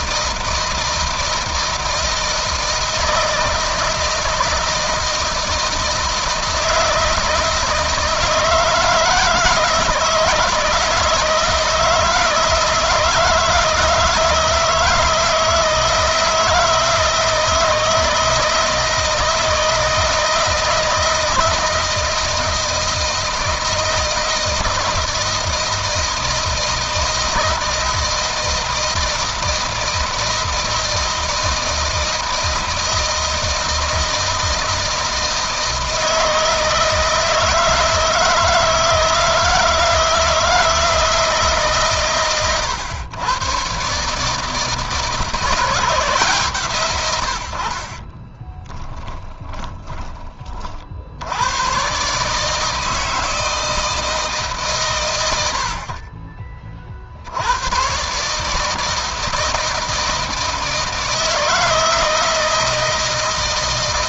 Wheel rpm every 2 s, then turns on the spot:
160, 160, 160, 160, 160, 160, 160, 160, 160, 160, 160, 160, 160, 160, 170, 160, 160, 160, 160, 160, 160, 110, 160, 110, 10, 60, 160, 120, 50, 160, 160, 160.
48-50